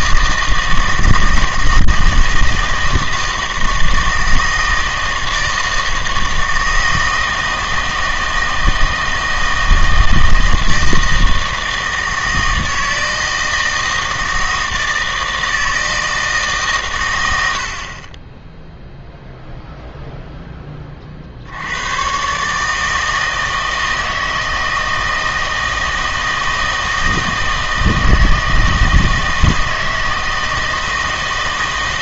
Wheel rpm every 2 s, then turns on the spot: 160, 160, 160, 160, 160, 160, 160, 160, 140, 0, 20, 150, 160, 160, 160, 160.
none